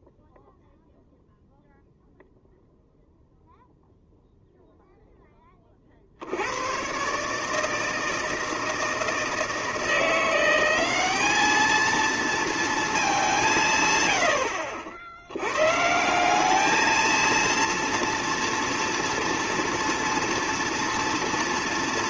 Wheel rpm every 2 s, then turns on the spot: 0, 0, 0, 100, 160, 180, 230, 70, 200, 230, 230.
none